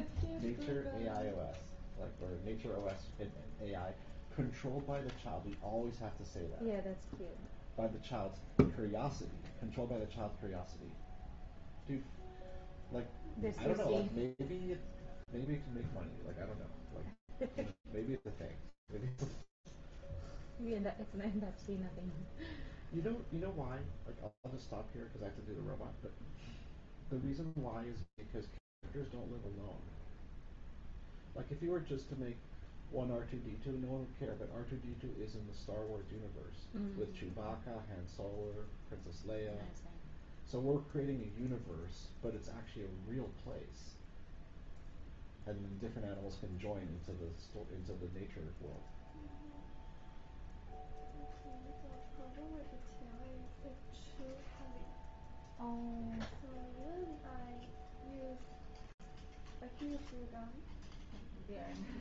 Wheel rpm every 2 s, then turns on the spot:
0, 0, 0, 0, 0, 0, 0, 0, 0, 0, 0, 0, 0, 0, 0, 0, 0, 0, 0, 0, 0, 0, 0, 0, 0, 0, 0, 0, 0, 0, 0.
none